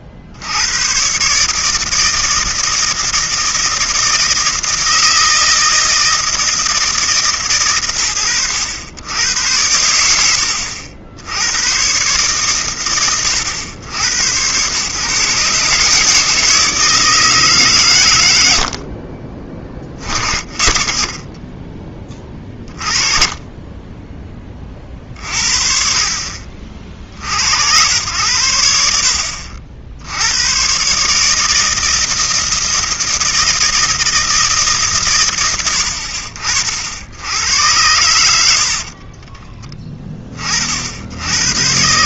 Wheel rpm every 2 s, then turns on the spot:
90, 160, 160, 160, 100, 80, 90, 130, 150, 40, 40, 20, 20, 30, 90, 100, 160, 160, 50, 70, 60.
38-40